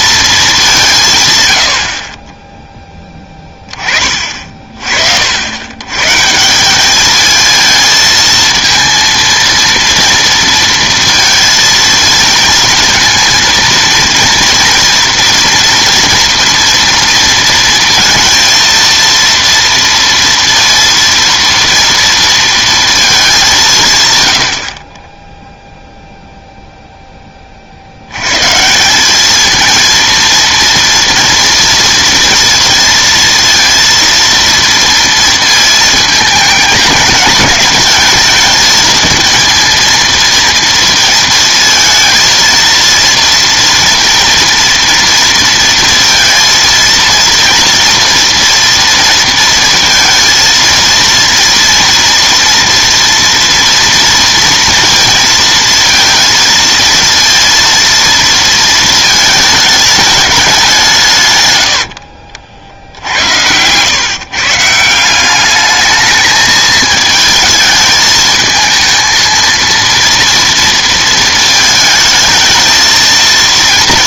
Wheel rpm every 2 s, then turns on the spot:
200, 10, 40, 170, 230, 230, 220, 230, 230, 230, 230, 230, 70, 0, 150, 230, 230, 230, 210, 220, 230, 230, 230, 230, 230, 230, 240, 230, 230, 230, 200, 70, 150, 220, 220, 230, 220.
none